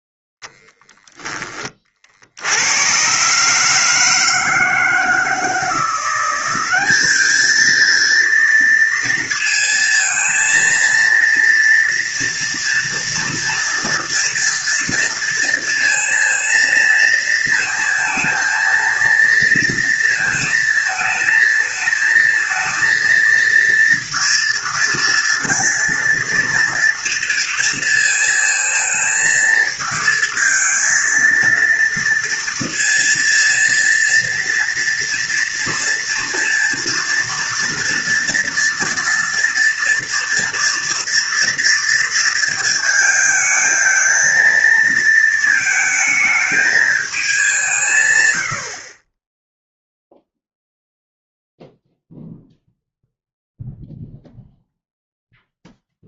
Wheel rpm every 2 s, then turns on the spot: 20, 80, 160, 190, 230, 230, 230, 230, 230, 230, 230, 230, 230, 230, 230, 230, 230, 230, 230, 230, 230, 220, 230, 220, 80, 0, 0, 0.
none